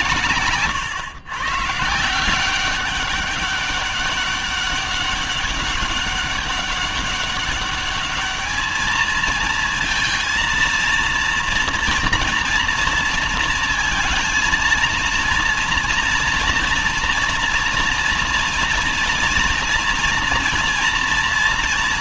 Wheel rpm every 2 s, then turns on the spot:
130, 180, 200, 200, 210, 230, 230, 230, 240, 230, 230.
none